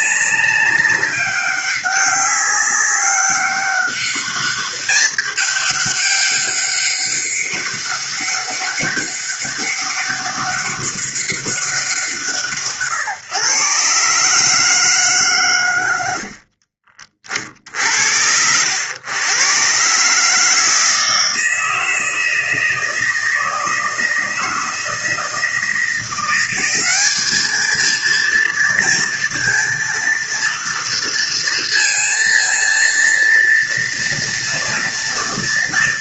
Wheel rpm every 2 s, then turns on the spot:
200, 200, 210, 200, 200, 200, 150, 160, 40, 90, 160, 160, 160, 190, 230, 230, 230, 230.
16-18